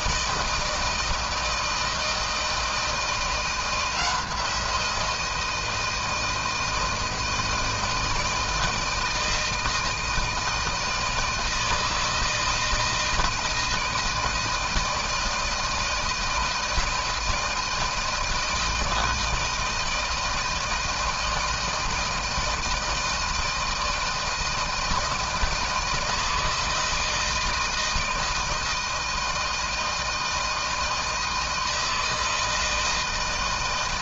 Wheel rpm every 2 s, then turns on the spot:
160, 160, 170, 160, 160, 160, 160, 160, 160, 160, 160, 160, 160, 160, 160, 160, 160.
none